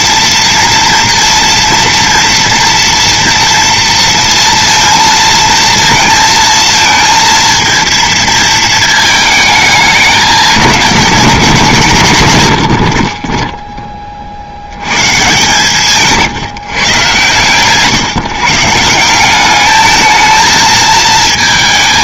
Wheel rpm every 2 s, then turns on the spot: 230, 230, 230, 220, 220, 210, 80, 90, 150, 150, 220.
none